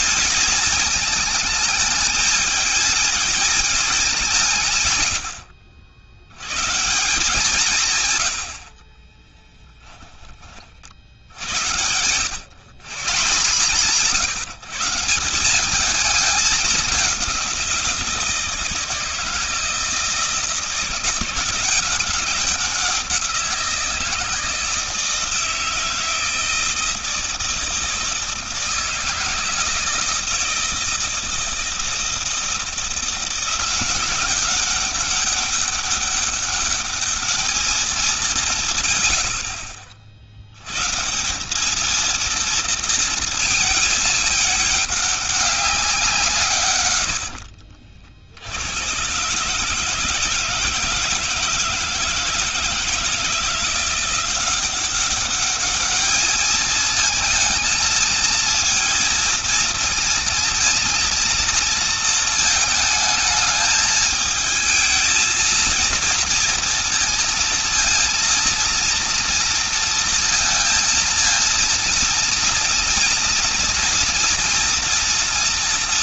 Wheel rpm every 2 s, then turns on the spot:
220, 220, 150, 140, 80, 50, 130, 160, 200, 160, 170, 190, 160, 160, 160, 160, 170, 190, 200, 150, 120, 230, 210, 140, 90, 160, 160, 190, 220, 220, 230, 220, 220, 230, 230, 230, 230, 230.
8-10 46-48